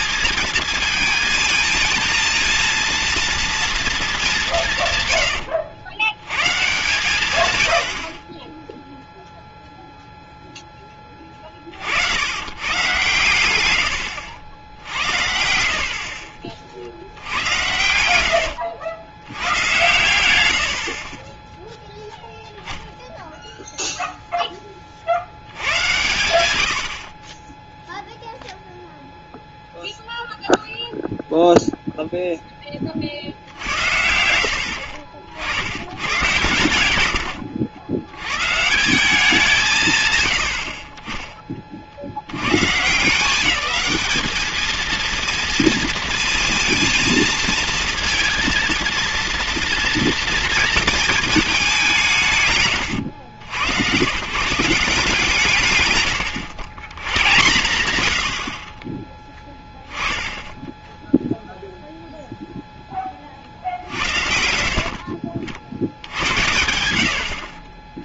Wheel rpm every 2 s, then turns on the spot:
220, 230, 170, 120, 10, 10, 120, 90, 50, 90, 80, 0, 10, 80, 0, 0, 10, 70, 120, 140, 50, 130, 220, 230, 230, 230, 120, 170, 110, 50, 0, 0, 60, 80.
18-22 34-36